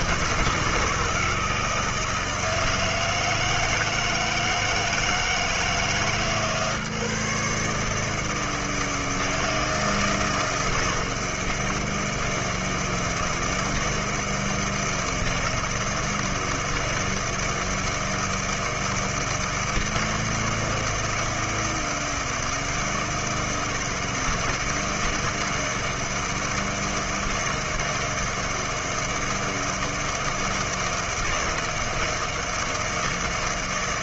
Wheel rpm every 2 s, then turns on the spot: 160, 160, 160, 150, 160, 160, 160, 160, 160, 160, 160, 160, 160, 160, 160, 160, 160.
none